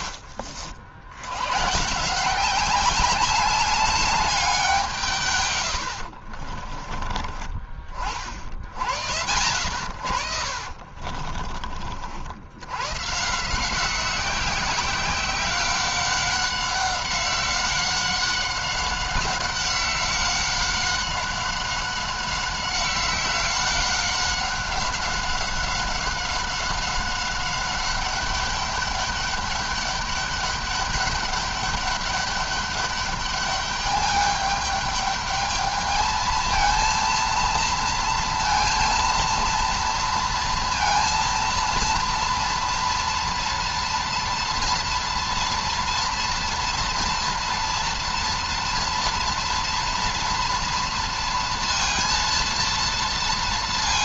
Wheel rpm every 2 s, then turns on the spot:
70, 190, 180, 30, 70, 50, 110, 190, 190, 190, 190, 190, 190, 190, 200, 200, 200, 210, 230, 230, 230, 230, 230, 230, 230, 230, 230.
10-12